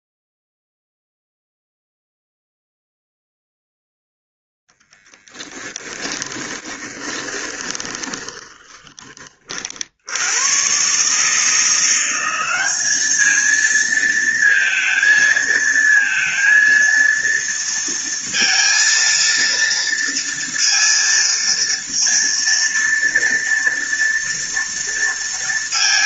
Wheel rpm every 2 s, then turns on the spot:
0, 0, 0, 20, 20, 130, 210, 230, 230, 230, 230, 230, 230.
6-8